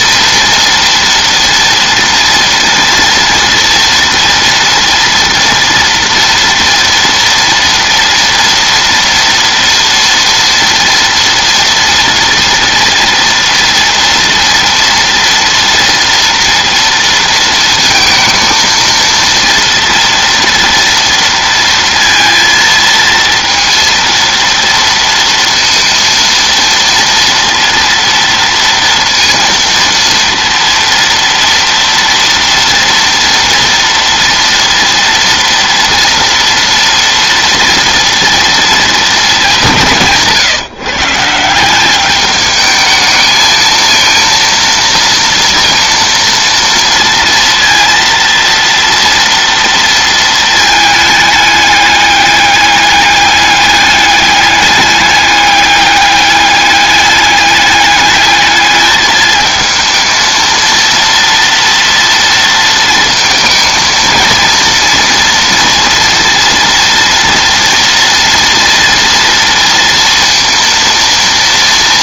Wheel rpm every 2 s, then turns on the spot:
240, 230, 230, 230, 240, 230, 230, 230, 230, 230, 230, 230, 230, 230, 230, 230, 230, 230, 230, 220, 150, 220, 230, 230, 230, 210, 200, 210, 210, 220, 230, 230, 230, 230, 230, 230.
none